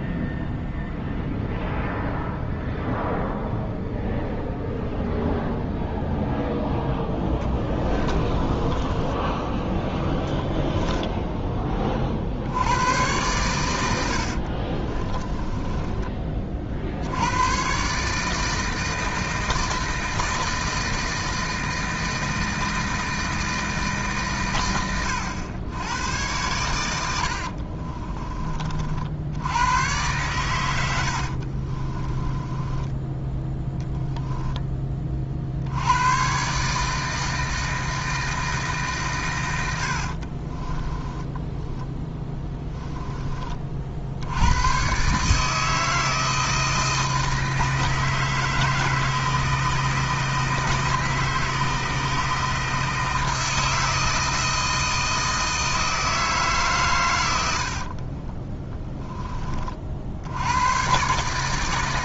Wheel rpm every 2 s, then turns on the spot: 0, 0, 0, 10, 20, 10, 100, 30, 60, 160, 160, 160, 100, 100, 50, 90, 10, 20, 160, 150, 20, 10, 130, 160, 160, 160, 160, 160, 130, 10, 120.
8-12 14-16 32-34 40-42